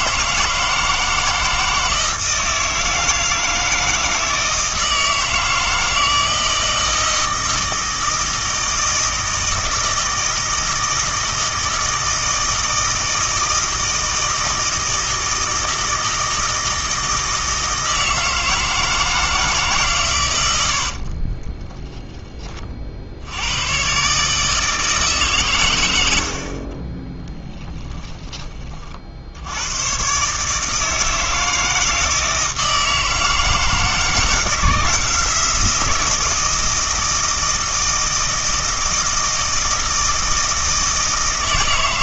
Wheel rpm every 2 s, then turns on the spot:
160, 160, 160, 160, 160, 160, 160, 160, 160, 160, 70, 30, 150, 40, 30, 150, 160, 170, 160, 160, 160.
20-22 26-28